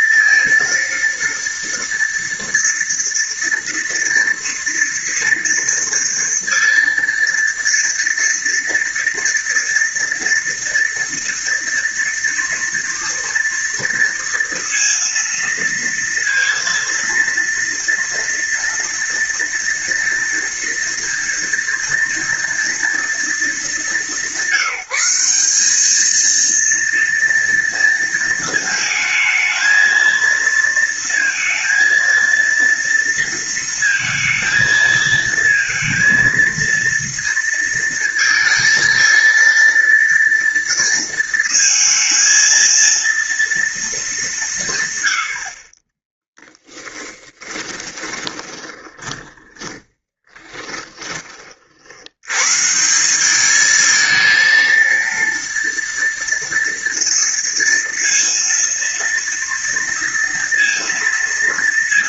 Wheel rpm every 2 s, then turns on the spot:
230, 230, 230, 230, 230, 230, 230, 230, 230, 230, 230, 220, 190, 230, 220, 230, 230, 230, 230, 230, 230, 230, 110, 10, 30, 20, 170, 230, 230, 230, 230.
46-52